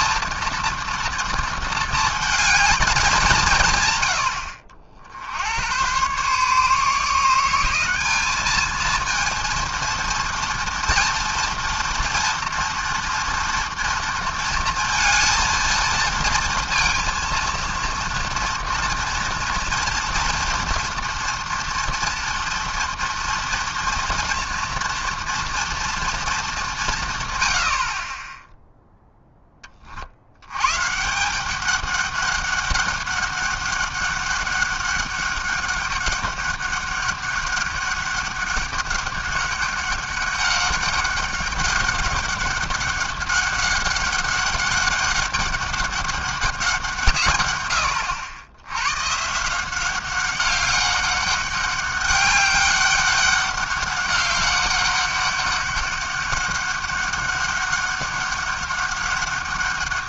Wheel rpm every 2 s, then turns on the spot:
230, 220, 70, 150, 220, 230, 230, 230, 230, 240, 240, 230, 230, 200, 0, 120, 200, 200, 200, 200, 200, 200, 200, 190, 100, 200, 200, 200, 200, 200.
none